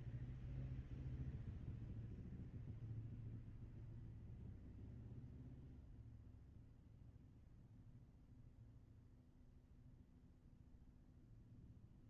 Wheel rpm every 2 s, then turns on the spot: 0, 0, 0, 0, 0, 0.
none